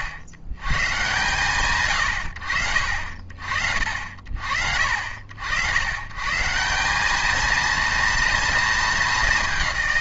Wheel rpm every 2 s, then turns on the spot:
100, 40, 60, 180, 230.
none